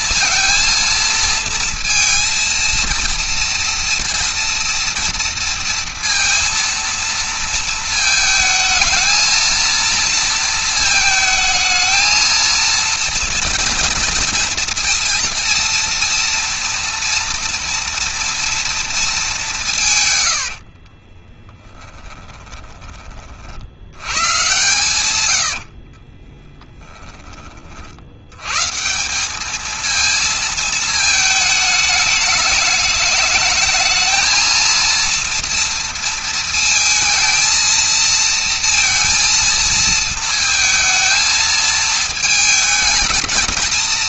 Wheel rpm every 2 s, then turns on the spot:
230, 230, 230, 230, 220, 230, 230, 230, 230, 230, 50, 30, 110, 20, 190, 220, 220, 230, 230, 230, 220, 220.
20-22 24-26